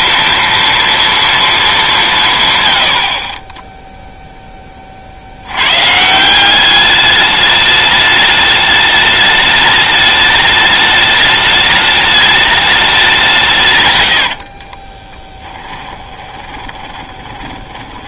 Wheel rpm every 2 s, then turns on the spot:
230, 100, 20, 200, 210, 210, 210, 30, 20.
14-18